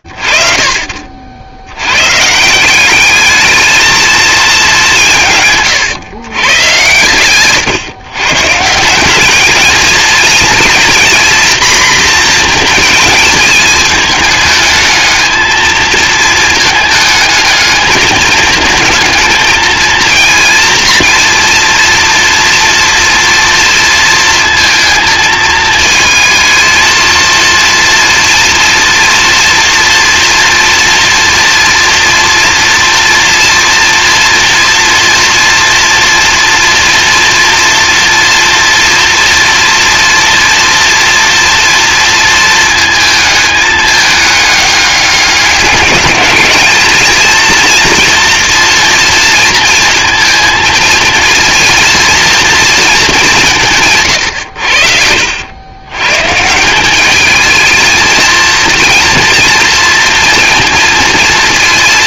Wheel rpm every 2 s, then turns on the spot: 60, 150, 220, 130, 150, 230, 230, 220, 220, 220, 230, 240, 230, 230, 230, 230, 230, 240, 240, 230, 230, 230, 210, 210, 230, 230, 240, 110, 160, 230, 230.
none